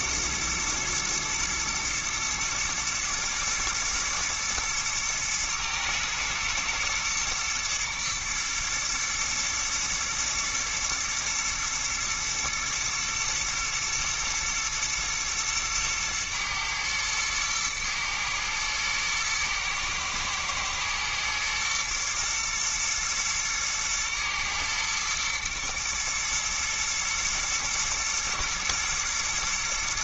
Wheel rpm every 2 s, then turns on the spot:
120, 120, 110, 110, 110, 120, 110, 120, 110, 110, 110, 110, 110, 120, 120.
none